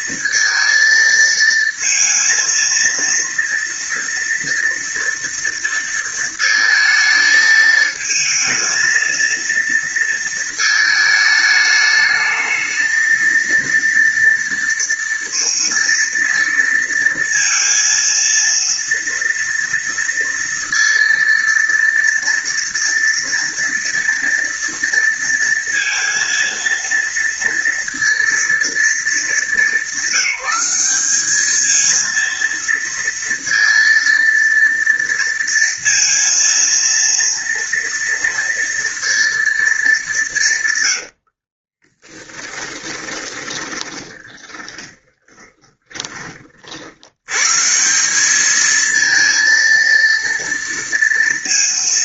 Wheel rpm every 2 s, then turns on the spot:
230, 230, 230, 220, 230, 220, 220, 230, 230, 230, 230, 230, 230, 230, 230, 190, 230, 230, 230, 230, 160, 20, 20, 40, 210, 230.
42-46